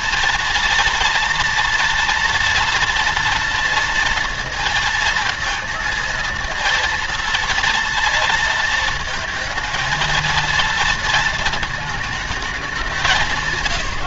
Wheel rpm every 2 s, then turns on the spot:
230, 230, 230, 230, 230, 230, 190.
none